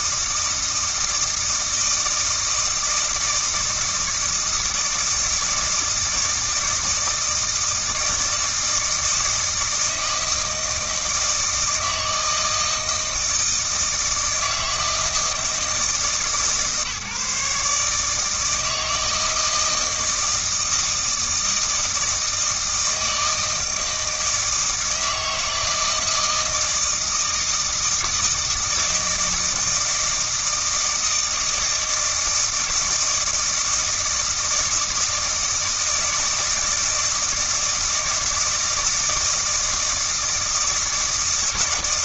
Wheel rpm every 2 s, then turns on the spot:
160, 160, 160, 160, 160, 160, 160, 160, 150, 160, 160, 160, 160, 160, 160, 160, 160, 160, 160, 160, 160.
none